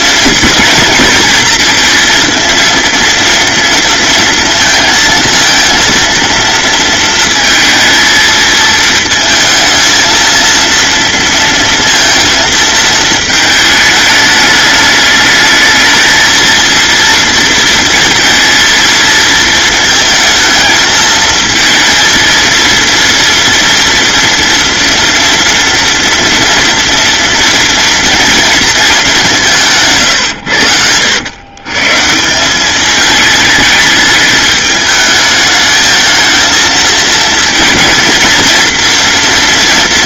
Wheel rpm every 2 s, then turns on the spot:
220, 230, 230, 230, 220, 230, 220, 210, 230, 230, 220, 230, 230, 230, 210, 80, 210, 210, 230, 230.
none